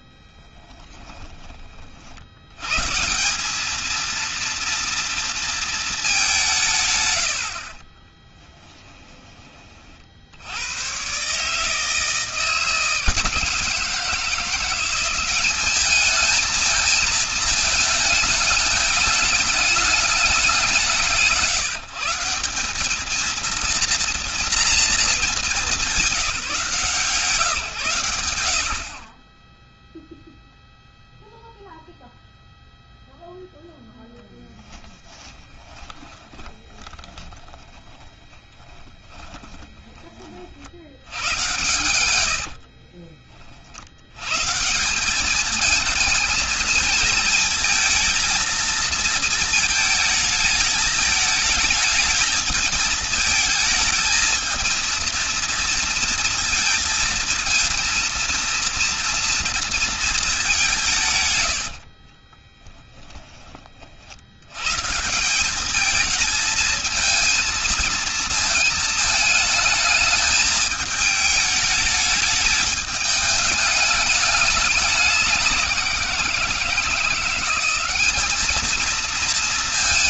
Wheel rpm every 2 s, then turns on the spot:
10, 120, 230, 160, 10, 110, 160, 180, 220, 210, 180, 190, 230, 160, 60, 0, 0, 10, 20, 10, 60, 50, 160, 230, 220, 220, 220, 220, 230, 230, 180, 10, 120, 220, 220, 220, 210, 210, 170, 220.
0-2 34-40 42-44 62-64